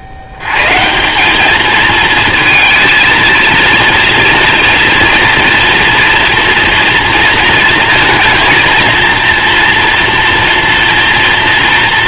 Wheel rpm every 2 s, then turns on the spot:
80, 220, 230, 230, 230, 230.
none